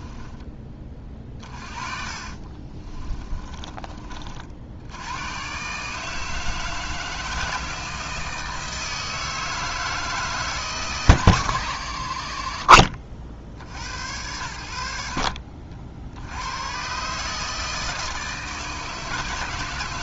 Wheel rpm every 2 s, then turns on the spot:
30, 30, 80, 160, 160, 150, 50, 80, 110, 160.
2-4